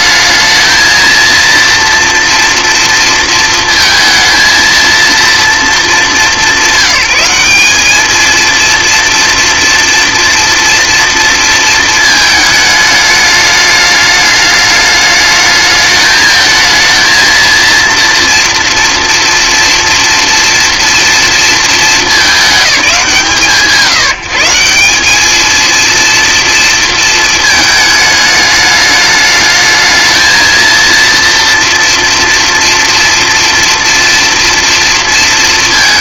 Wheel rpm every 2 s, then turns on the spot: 220, 230, 230, 170, 230, 230, 210, 210, 220, 230, 240, 200, 170, 230, 210, 230, 240, 230.
none